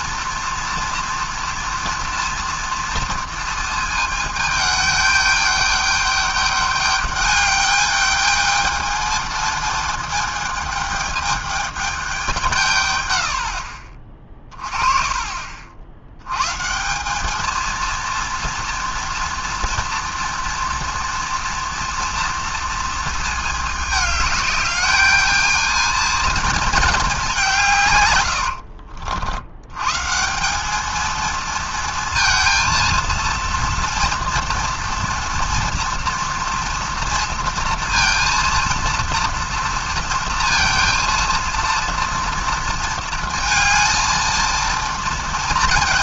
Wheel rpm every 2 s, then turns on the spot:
230, 240, 210, 210, 220, 220, 140, 30, 160, 230, 230, 230, 210, 220, 80, 210, 230, 230, 230, 230, 230, 230, 230.
28-30